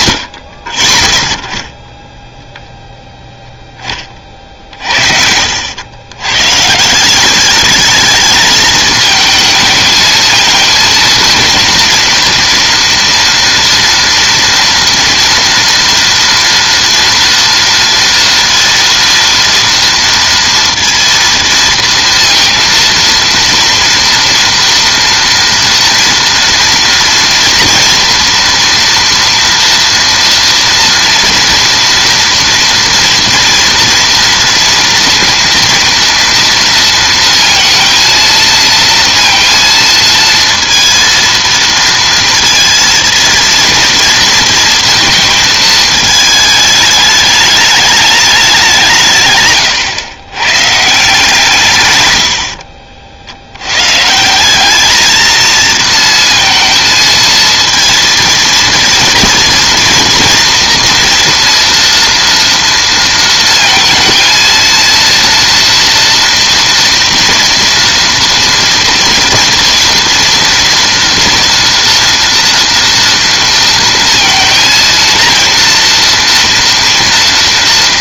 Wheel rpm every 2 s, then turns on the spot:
50, 0, 50, 140, 220, 230, 230, 230, 230, 230, 230, 230, 230, 230, 230, 230, 230, 230, 230, 230, 230, 230, 230, 210, 180, 130, 60, 200, 220, 230, 230, 230, 230, 230, 230, 230, 230, 230, 230.
52-54